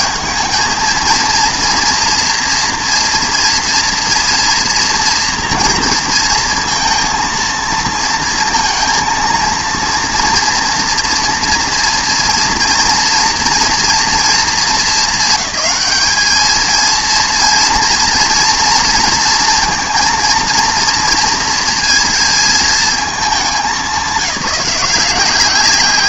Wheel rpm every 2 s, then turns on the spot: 220, 230, 240, 230, 230, 230, 230, 220, 220, 230, 230, 230, 190.
none